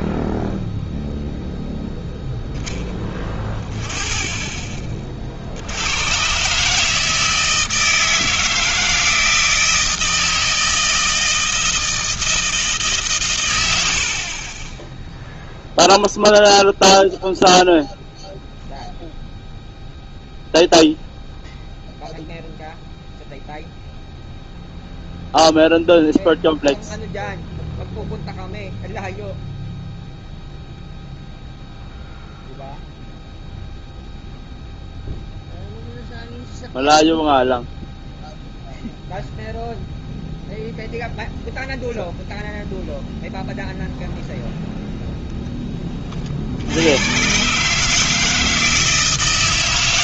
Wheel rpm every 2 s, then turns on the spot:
0, 10, 20, 140, 160, 160, 160, 20, 0, 0, 0, 0, 0, 0, 0, 0, 0, 0, 0, 0, 0, 0, 0, 70, 160.
none